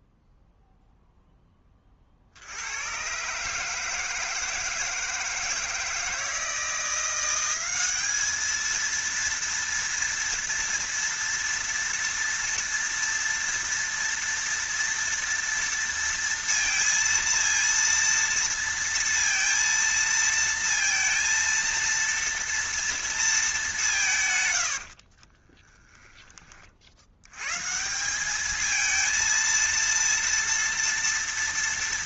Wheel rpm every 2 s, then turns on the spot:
0, 110, 160, 170, 230, 230, 230, 230, 230, 230, 230, 230, 50, 70, 220, 230.
24-26